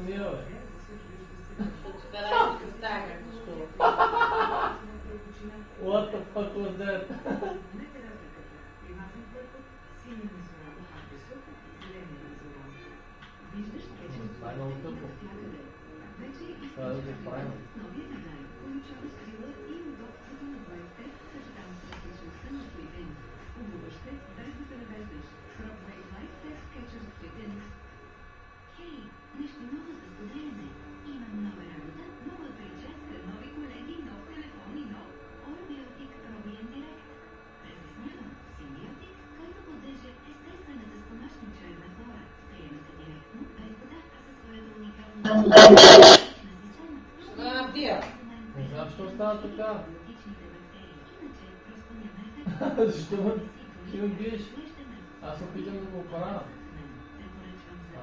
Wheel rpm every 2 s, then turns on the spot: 0, 0, 0, 0, 0, 0, 0, 0, 0, 0, 0, 0, 0, 0, 0, 0, 0, 0, 0, 0, 0, 0, 0, 0, 0, 0, 0, 0, 0.
none